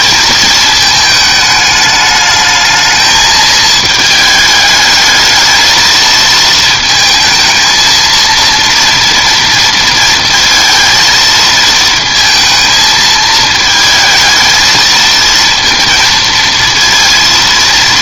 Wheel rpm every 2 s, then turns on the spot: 220, 220, 210, 230, 230, 230, 220, 220, 230.
none